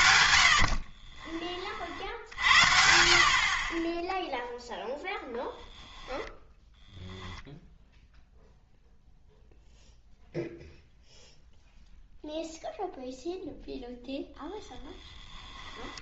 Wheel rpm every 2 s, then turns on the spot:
50, 60, 0, 10, 0, 0, 0, 10.
14-16